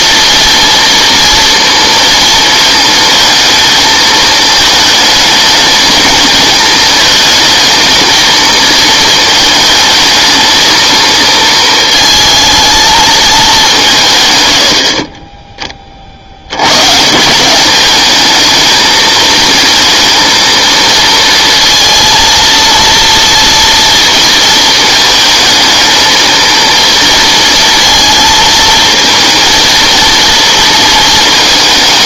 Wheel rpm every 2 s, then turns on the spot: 230, 220, 220, 220, 220, 220, 220, 100, 100, 220, 230, 230, 220, 230, 230, 230.
none